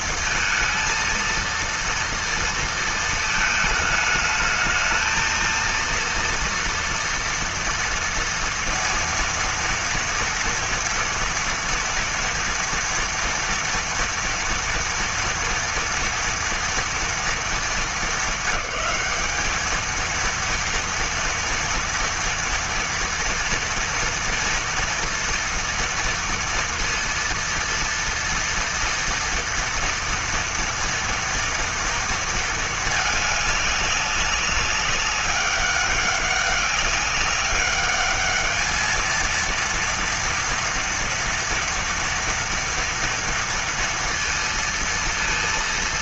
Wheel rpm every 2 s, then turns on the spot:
230, 230, 220, 230, 230, 230, 230, 230, 230, 200, 230, 230, 230, 230, 230, 230, 220, 200, 200, 210, 230, 230, 230.
none